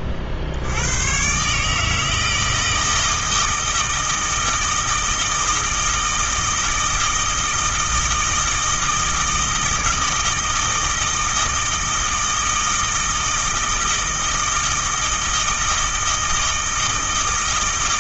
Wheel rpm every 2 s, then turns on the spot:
80, 160, 160, 160, 160, 160, 160, 160, 160.
none